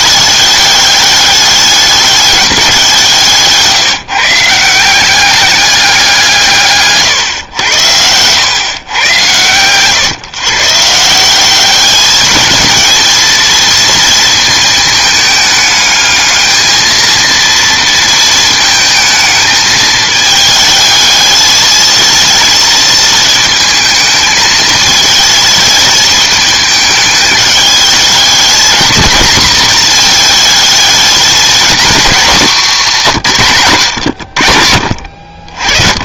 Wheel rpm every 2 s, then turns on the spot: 200, 190, 170, 150, 120, 140, 220, 220, 220, 230, 220, 230, 220, 210, 220, 220, 220, 80.
none